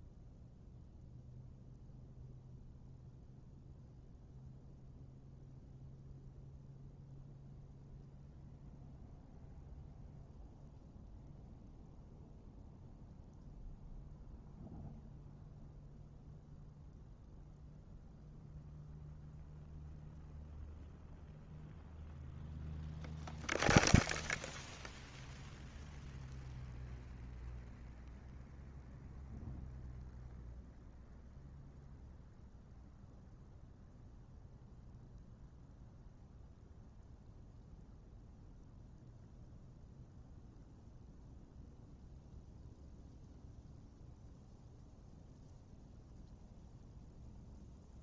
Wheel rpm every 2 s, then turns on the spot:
0, 0, 0, 0, 0, 0, 0, 0, 0, 0, 0, 0, 0, 0, 0, 0, 0, 0, 0, 0, 0, 0, 0, 0.
none